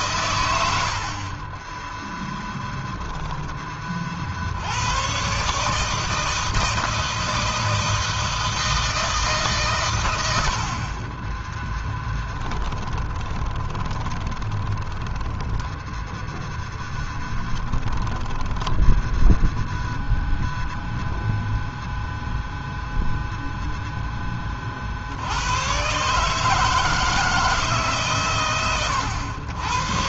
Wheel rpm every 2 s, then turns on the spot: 100, 0, 80, 160, 160, 70, 10, 20, 0, 10, 0, 0, 20, 150, 120.
12-16 18-20